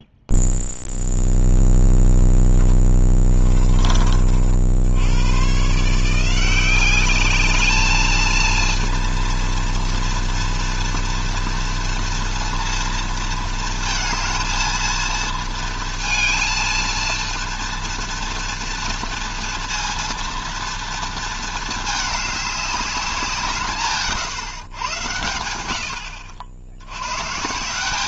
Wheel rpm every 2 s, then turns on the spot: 0, 10, 50, 180, 230, 230, 230, 220, 230, 230, 230, 210, 130, 80.
none